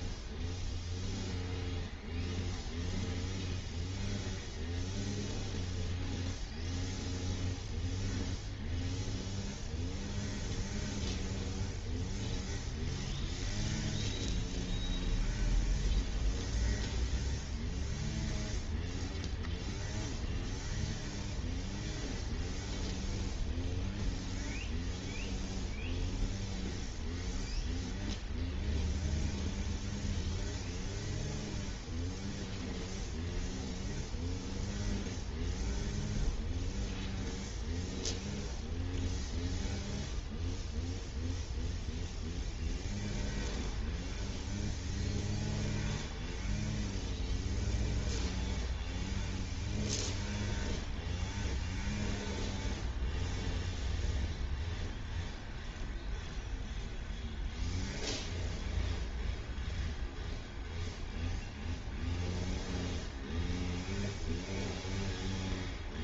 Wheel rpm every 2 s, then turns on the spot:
0, 0, 0, 0, 0, 0, 0, 0, 0, 0, 0, 0, 0, 0, 0, 0, 0, 0, 0, 0, 0, 0, 0, 0, 0, 0, 0, 0, 0, 0, 0, 0, 0.
none